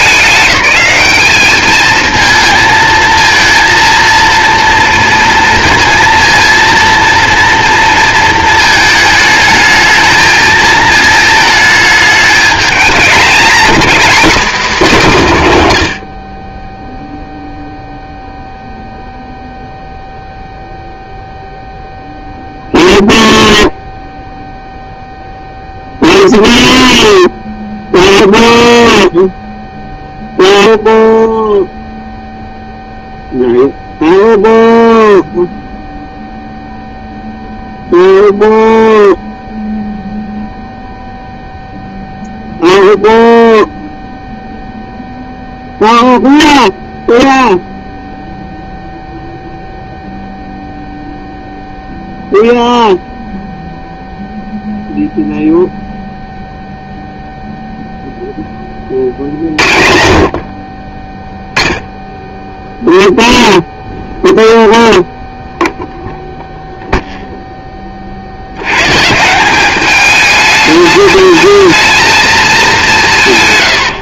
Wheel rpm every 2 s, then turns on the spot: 200, 230, 240, 230, 220, 220, 220, 240, 0, 0, 0, 0, 0, 0, 0, 0, 0, 0, 0, 0, 0, 0, 0, 0, 0, 0, 0, 0, 0, 40, 30, 0, 0, 0, 120, 210, 180.
none